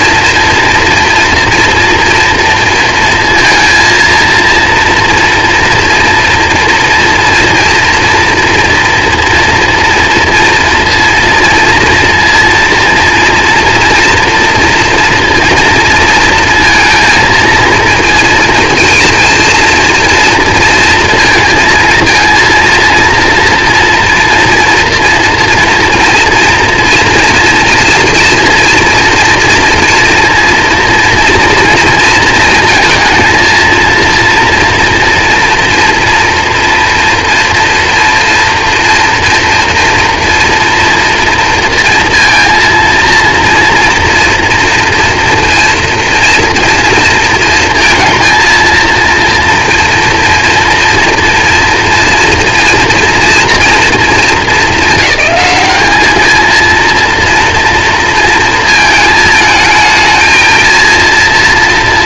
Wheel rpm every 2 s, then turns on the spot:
230, 230, 230, 240, 230, 230, 230, 230, 230, 230, 230, 230, 230, 240, 240, 230, 230, 230, 230, 230, 240, 230, 230, 230, 230, 230, 230, 220, 220, 230, 220.
none